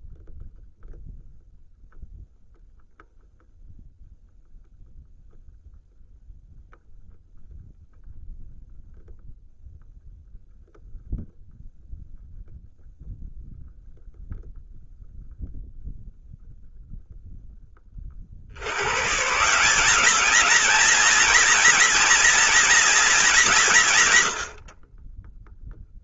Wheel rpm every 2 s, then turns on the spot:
0, 0, 0, 0, 0, 0, 0, 0, 0, 140, 230, 230, 40.
none